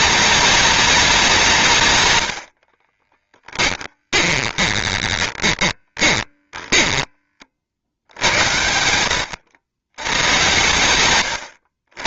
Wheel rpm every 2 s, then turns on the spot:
210, 50, 20, 20, 90, 90.
2-8